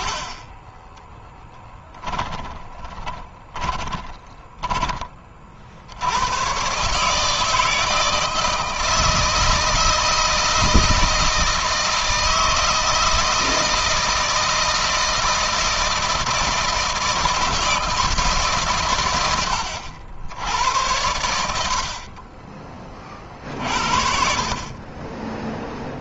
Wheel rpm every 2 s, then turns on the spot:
0, 20, 20, 140, 160, 160, 160, 160, 160, 110, 90, 30, 40.
2-4